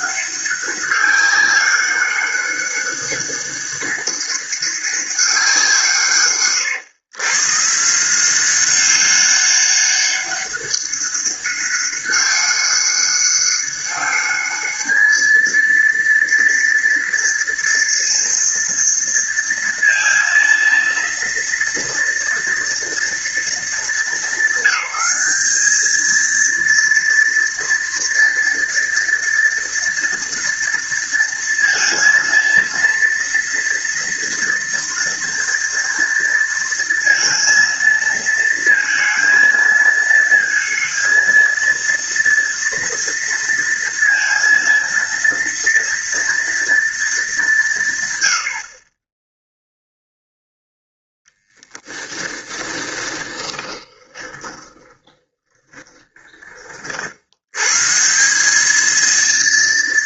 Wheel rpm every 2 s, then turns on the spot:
200, 200, 200, 120, 190, 200, 200, 220, 230, 230, 230, 230, 210, 230, 230, 230, 230, 230, 230, 230, 230, 230, 230, 220, 30, 0, 20, 20, 60, 220.
52-56